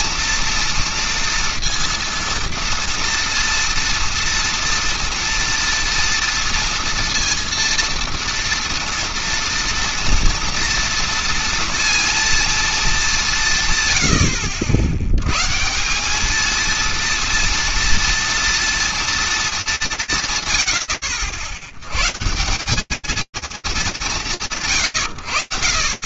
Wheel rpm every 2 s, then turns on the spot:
230, 230, 230, 230, 230, 230, 230, 70, 220, 230, 100, 180, 30.
none